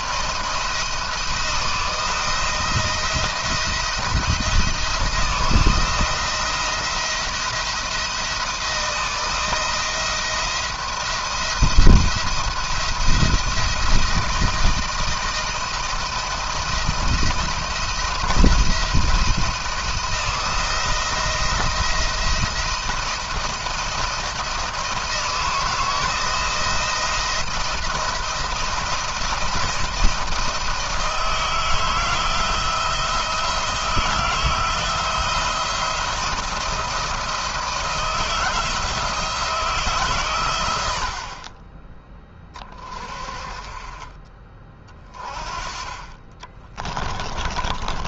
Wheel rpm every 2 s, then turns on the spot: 170, 170, 170, 170, 170, 170, 170, 160, 170, 170, 170, 170, 170, 170, 170, 160, 160, 170, 170, 160, 90, 30, 20, 20.
46-48